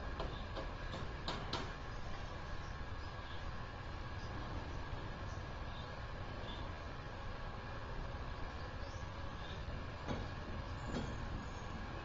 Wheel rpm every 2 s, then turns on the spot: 0, 0, 0, 0, 0, 0.
none